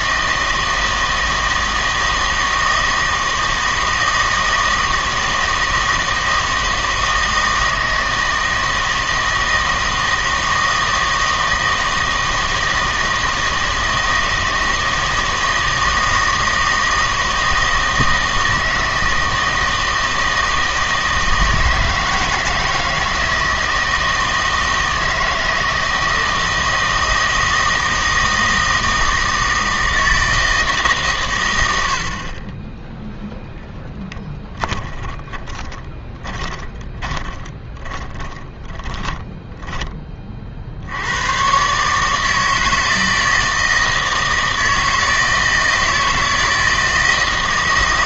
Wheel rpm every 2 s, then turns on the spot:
160, 160, 160, 160, 160, 160, 160, 160, 160, 160, 160, 160, 160, 160, 160, 150, 10, 20, 20, 20, 70, 160, 160, 160.
34-40